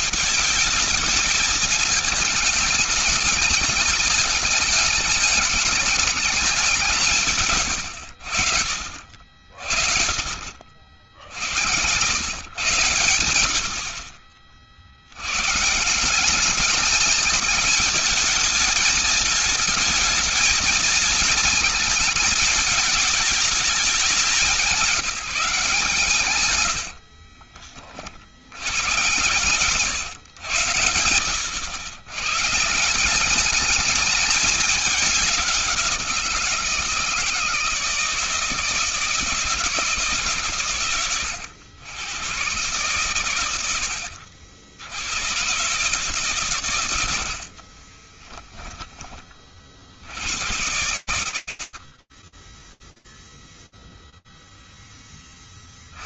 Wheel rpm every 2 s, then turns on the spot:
220, 220, 210, 190, 70, 70, 140, 70, 200, 220, 220, 210, 180, 80, 130, 100, 160, 200, 170, 160, 110, 120, 70, 110, 30, 90, 0, 0.
10-12 26-28 46-48